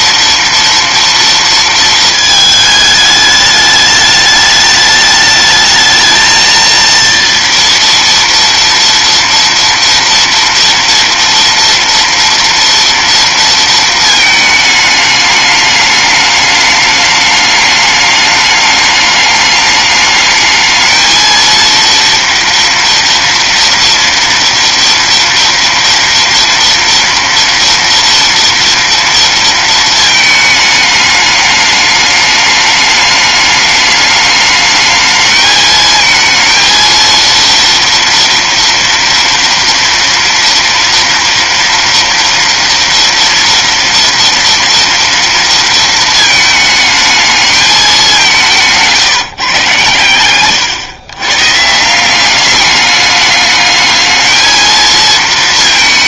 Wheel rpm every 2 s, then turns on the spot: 230, 220, 210, 230, 230, 230, 230, 210, 210, 210, 220, 230, 230, 230, 230, 220, 210, 210, 230, 230, 230, 230, 230, 220, 170, 110, 200, 220.
50-52